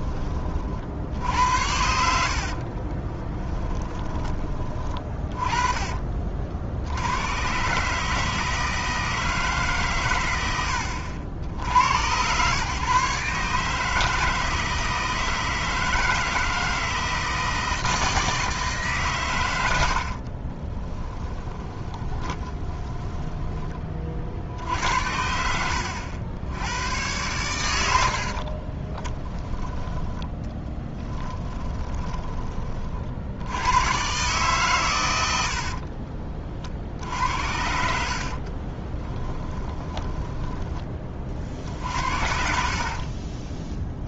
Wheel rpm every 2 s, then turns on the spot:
50, 30, 20, 70, 160, 80, 130, 160, 160, 150, 20, 20, 70, 100, 30, 10, 40, 120, 50, 30, 20, 50.
2-4 20-24 28-32 38-40 42-44